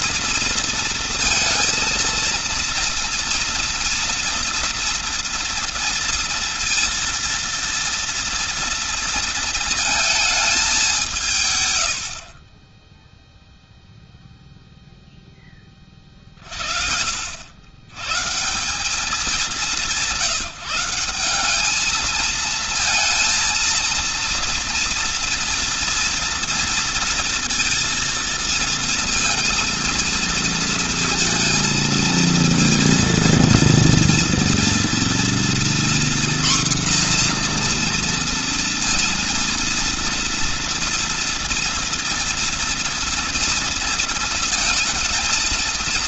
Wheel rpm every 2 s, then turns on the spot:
230, 230, 230, 230, 230, 210, 40, 0, 50, 160, 170, 220, 230, 230, 230, 230, 230, 230, 250, 240, 230, 230, 230.
none